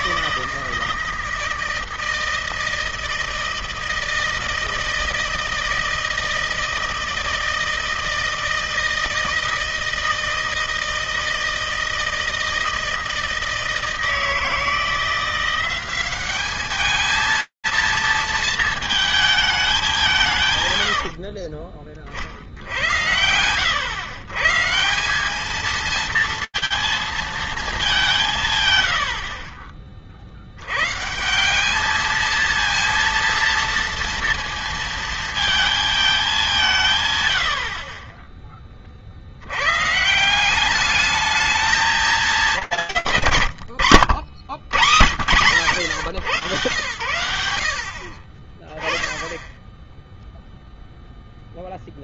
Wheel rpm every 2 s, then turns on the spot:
160, 160, 160, 160, 160, 160, 160, 160, 210, 230, 130, 70, 160, 230, 90, 120, 230, 230, 140, 50, 210, 90, 90, 90, 10, 0.
none